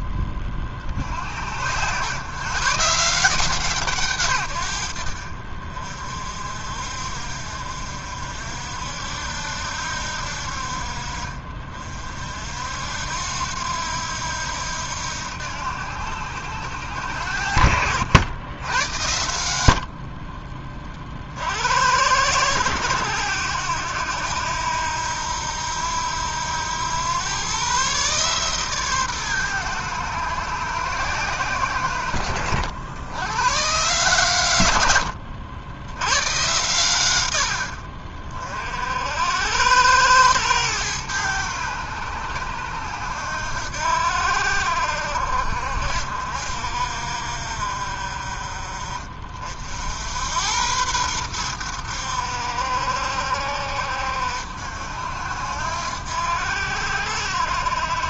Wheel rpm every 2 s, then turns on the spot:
50, 130, 90, 50, 70, 50, 60, 80, 80, 90, 30, 90, 80, 90, 140, 110, 80, 110, 120, 40, 110, 80, 60, 60, 30, 100, 60, 70, 70.
0-2